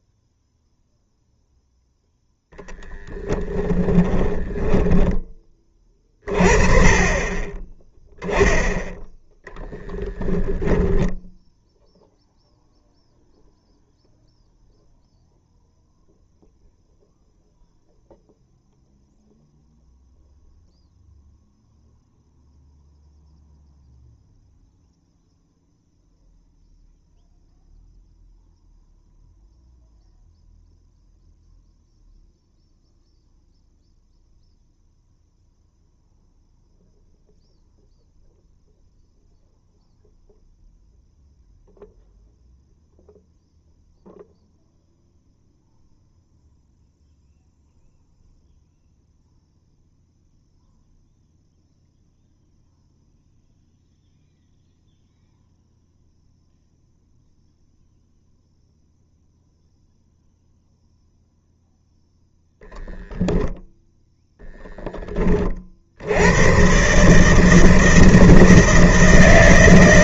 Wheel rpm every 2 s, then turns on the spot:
0, 0, 10, 30, 10, 0, 0, 0, 0, 0, 0, 0, 0, 0, 0, 0, 0, 0, 0, 0, 0, 0, 0, 0, 0, 0, 0, 0, 0, 0, 0, 0, 10, 120, 160.
4-6